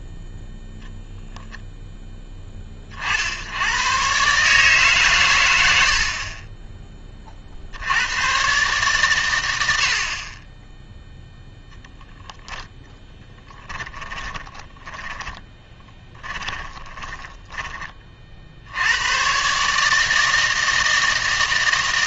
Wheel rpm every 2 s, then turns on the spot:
0, 30, 150, 30, 130, 10, 0, 10, 20, 80, 160.
14-18